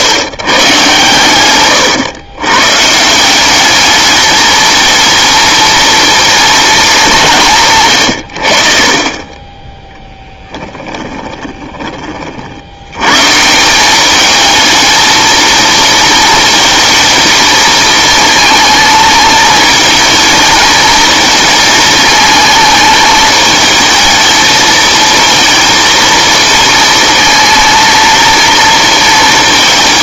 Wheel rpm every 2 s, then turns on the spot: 130, 150, 220, 210, 40, 20, 110, 220, 220, 220, 230, 220, 230, 230, 230.
8-12